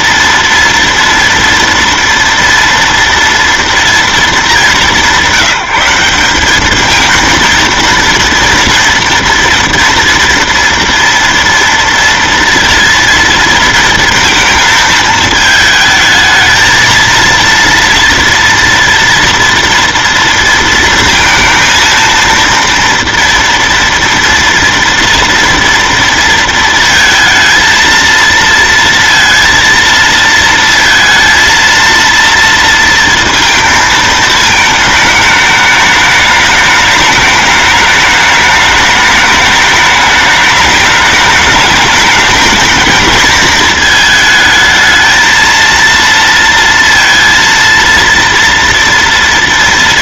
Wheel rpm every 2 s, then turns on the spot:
230, 230, 210, 200, 230, 230, 230, 230, 220, 230, 230, 230, 230, 230, 230, 230, 230, 220, 210, 210, 210, 220, 220, 230, 230.
none